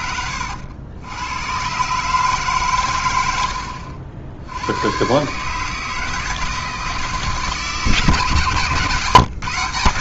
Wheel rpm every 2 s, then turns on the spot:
90, 130, 100, 160, 140.
none